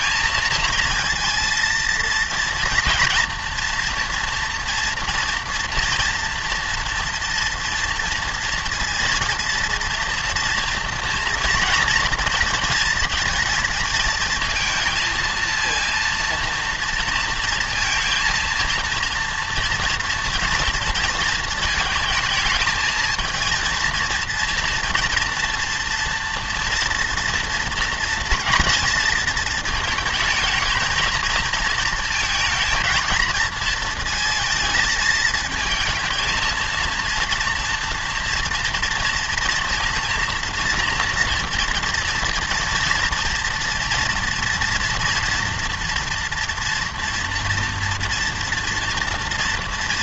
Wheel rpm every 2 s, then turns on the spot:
230, 230, 230, 230, 230, 230, 230, 230, 230, 230, 230, 220, 230, 230, 230, 220, 230, 220, 230, 230, 230, 230, 230, 240, 240.
none